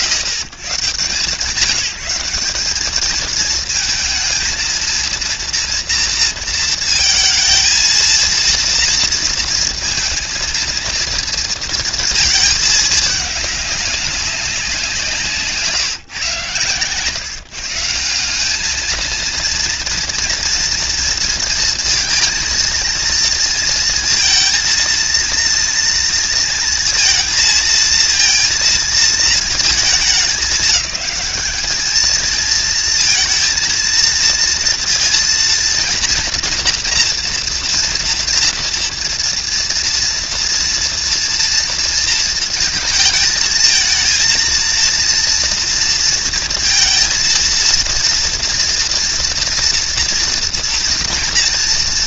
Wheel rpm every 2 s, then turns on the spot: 120, 190, 230, 230, 230, 230, 210, 180, 110, 210, 230, 230, 230, 230, 230, 200, 220, 230, 240, 230, 230, 220, 230, 230, 230, 230.
none